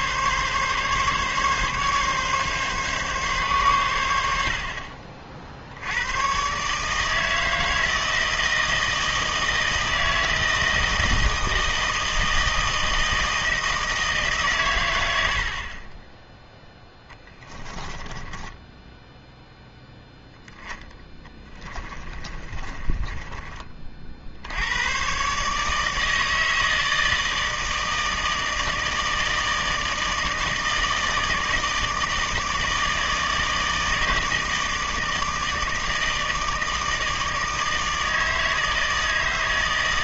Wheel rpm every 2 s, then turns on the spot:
140, 140, 60, 140, 160, 160, 160, 110, 10, 10, 10, 20, 100, 160, 160, 160, 160, 160, 160, 160.
16-20 22-24